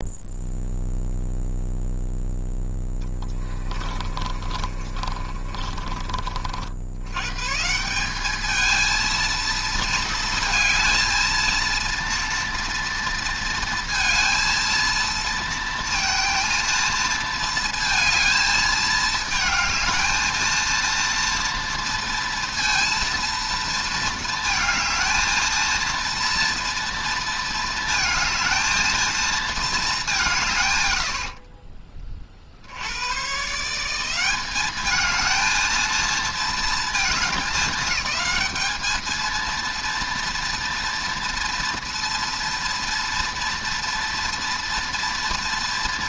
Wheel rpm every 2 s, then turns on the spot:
0, 10, 30, 60, 210, 220, 230, 230, 230, 220, 230, 230, 230, 230, 220, 140, 60, 200, 230, 210, 230, 230, 230.
2-6